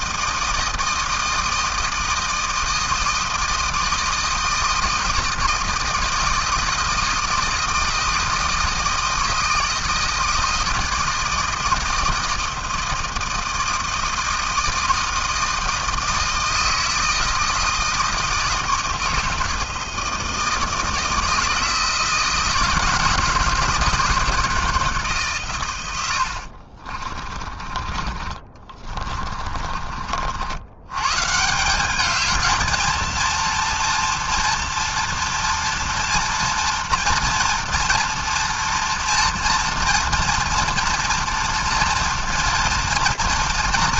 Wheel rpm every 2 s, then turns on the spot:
160, 160, 160, 160, 160, 160, 160, 160, 160, 160, 160, 160, 160, 60, 30, 90, 220, 230, 230, 230, 230, 230.
26-30